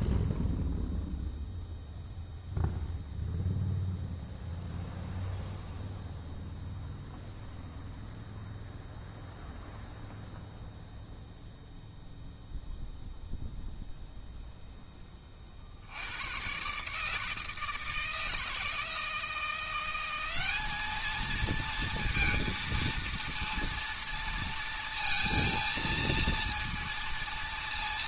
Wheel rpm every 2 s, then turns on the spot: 0, 0, 0, 0, 0, 0, 0, 10, 140, 160, 210, 230, 230, 230.
none